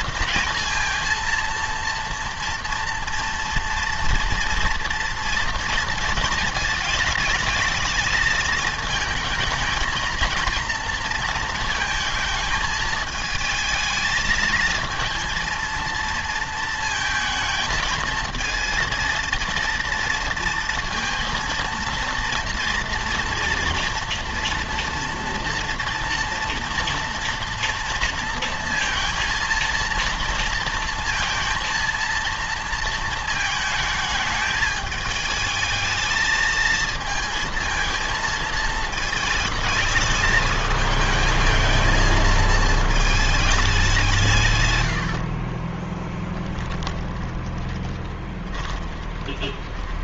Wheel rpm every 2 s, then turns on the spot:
230, 230, 230, 220, 220, 230, 220, 220, 230, 220, 230, 230, 230, 230, 220, 230, 230, 210, 220, 220, 220, 220, 130, 10, 20.
44-50